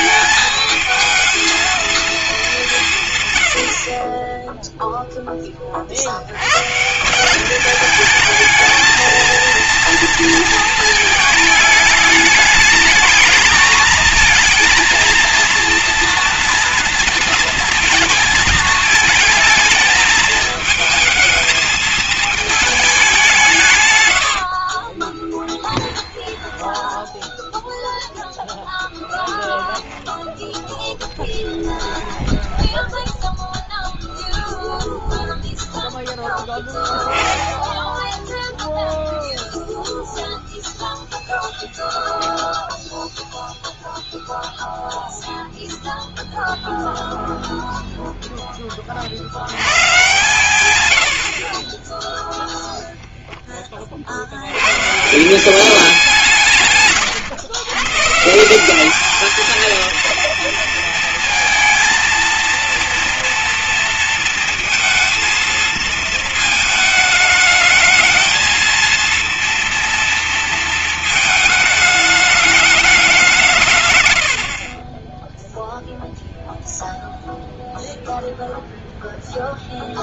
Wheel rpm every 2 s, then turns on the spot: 220, 200, 10, 130, 220, 230, 210, 230, 230, 220, 220, 210, 60, 20, 10, 10, 10, 0, 0, 0, 0, 0, 0, 0, 20, 110, 0, 110, 160, 180, 230, 230, 230, 220, 220, 220, 210, 40, 0, 0.
24-28 32-34